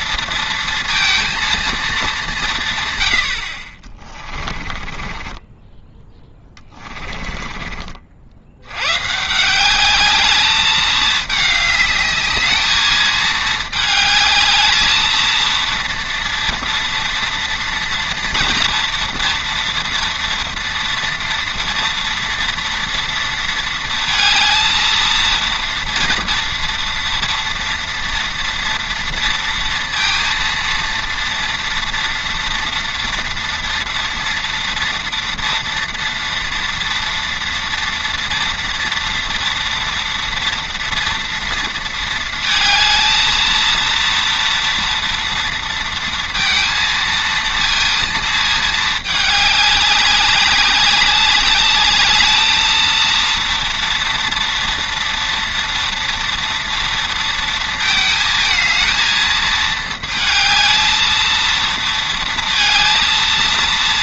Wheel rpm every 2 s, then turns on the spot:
230, 140, 30, 20, 100, 210, 220, 220, 230, 230, 230, 230, 230, 230, 240, 230, 230, 230, 230, 230, 230, 220, 230, 230, 220, 200, 220, 230, 230, 220, 220, 230.
4-8